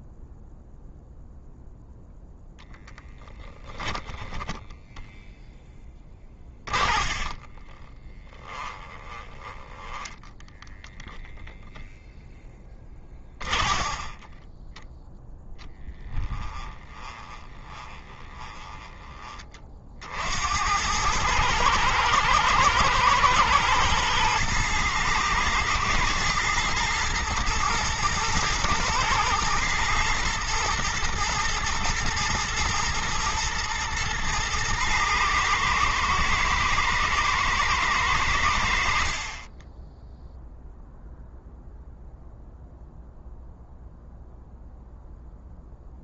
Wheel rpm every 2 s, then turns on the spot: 0, 10, 20, 30, 20, 0, 20, 10, 20, 20, 100, 110, 110, 110, 110, 120, 110, 110, 110, 70, 0, 0, 0.
2-4 6-10 12-14 16-18